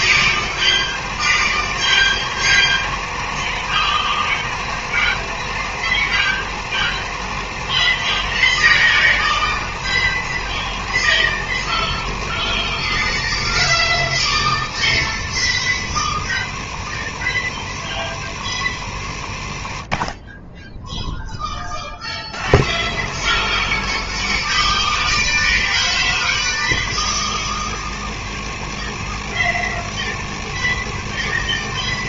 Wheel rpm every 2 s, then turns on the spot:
90, 90, 90, 90, 90, 80, 70, 70, 70, 60, 10, 80, 70, 70, 70, 70.
none